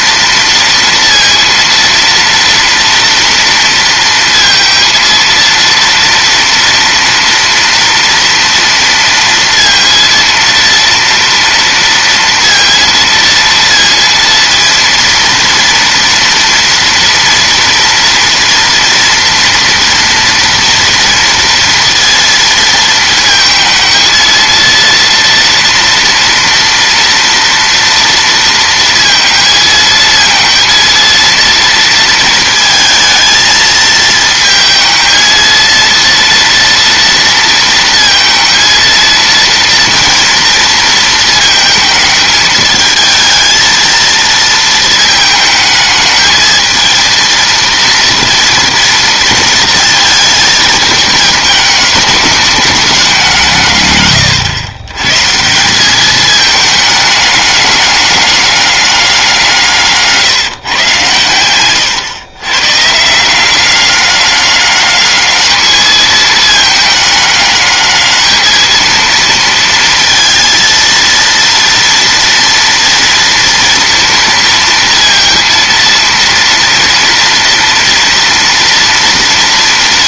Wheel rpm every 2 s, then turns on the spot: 230, 230, 230, 230, 230, 230, 230, 230, 230, 230, 230, 230, 230, 230, 230, 230, 220, 220, 240, 230, 230, 220, 220, 220, 230, 220, 210, 120, 210, 200, 140, 130, 200, 210, 220, 230, 230, 230, 230, 230.
none